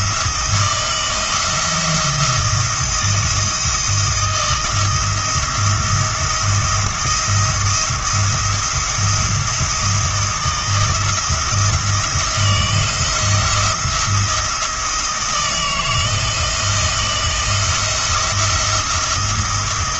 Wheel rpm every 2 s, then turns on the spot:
160, 170, 170, 170, 170, 170, 170, 170, 160, 170.
none